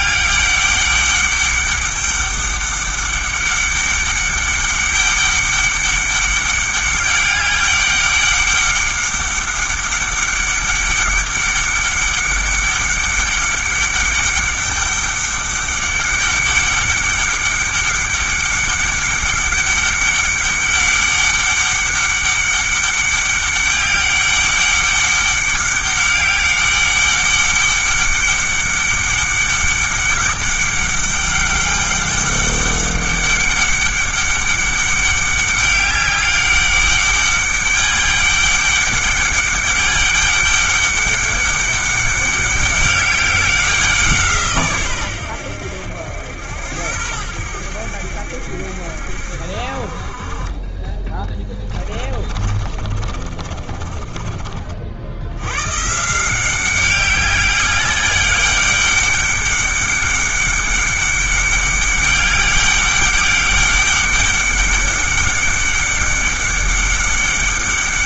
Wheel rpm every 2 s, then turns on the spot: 200, 200, 200, 200, 200, 200, 200, 200, 200, 200, 200, 200, 200, 200, 200, 200, 200, 200, 200, 200, 200, 200, 130, 90, 70, 30, 40, 50, 190, 200, 200, 200, 200, 200.
52-54